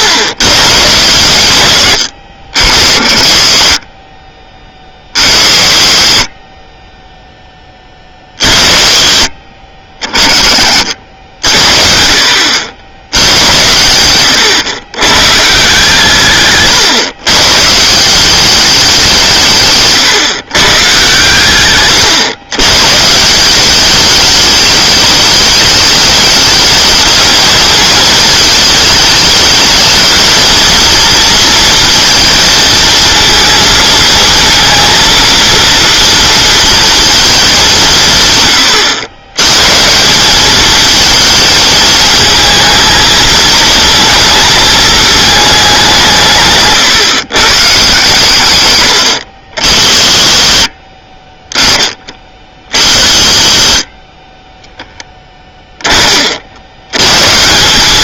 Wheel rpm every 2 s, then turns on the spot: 130, 60, 30, 20, 70, 50, 80, 110, 130, 200, 120, 120, 210, 210, 220, 230, 230, 230, 230, 120, 220, 230, 220, 140, 110, 30, 40, 10, 80.
16-18